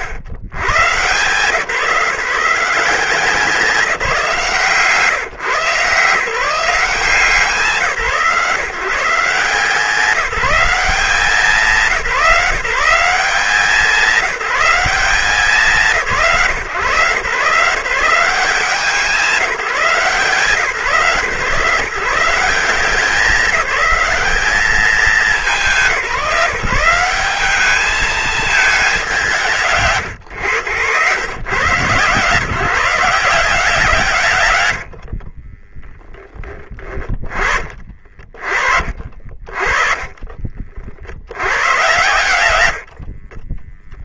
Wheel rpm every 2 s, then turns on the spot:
110, 170, 160, 180, 160, 190, 180, 180, 160, 190, 150, 180, 200, 180, 210, 110, 150, 100, 10, 50, 30, 100.
34-36